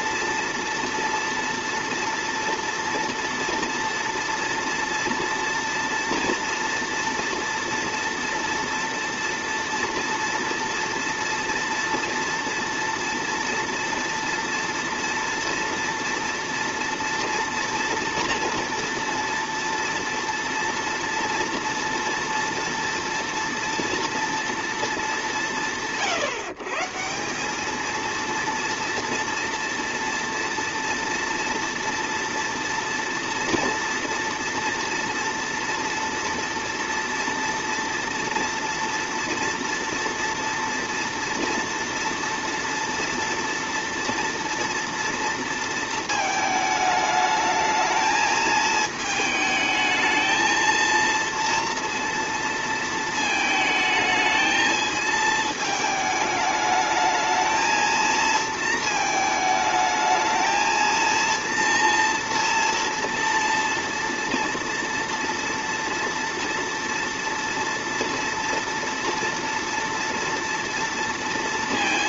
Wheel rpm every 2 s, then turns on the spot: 230, 240, 230, 230, 230, 230, 230, 230, 230, 230, 230, 230, 230, 150, 230, 230, 230, 230, 230, 230, 230, 230, 230, 220, 220, 220, 230, 220, 210, 230, 220, 230, 230, 230, 230, 230.
none